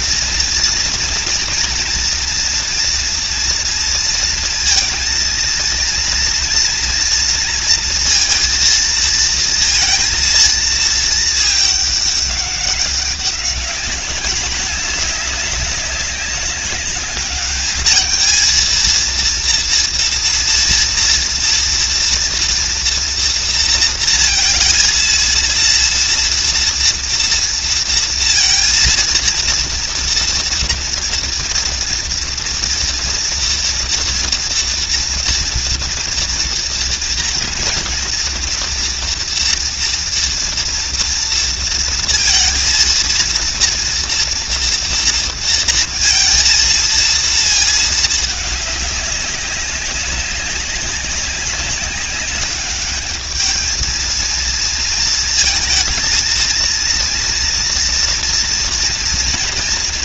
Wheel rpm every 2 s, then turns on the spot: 230, 230, 230, 230, 230, 220, 200, 210, 200, 220, 230, 230, 230, 230, 230, 230, 230, 230, 230, 240, 230, 230, 240, 230, 200, 190, 200, 230, 230, 230.
none